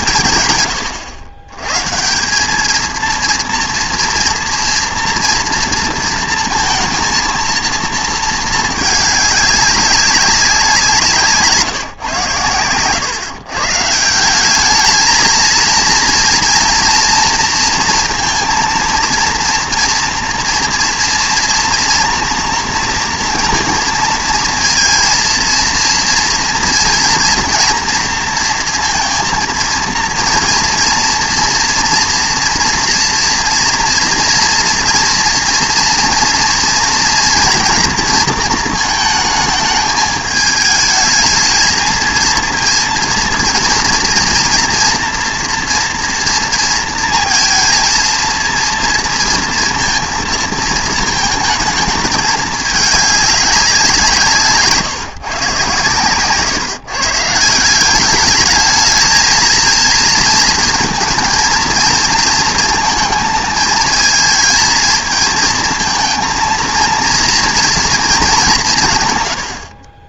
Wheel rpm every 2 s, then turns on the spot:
110, 230, 230, 230, 210, 170, 120, 220, 240, 230, 230, 230, 230, 230, 230, 230, 230, 230, 230, 220, 220, 230, 240, 230, 230, 220, 210, 150, 130, 220, 230, 230, 220, 230, 160.
none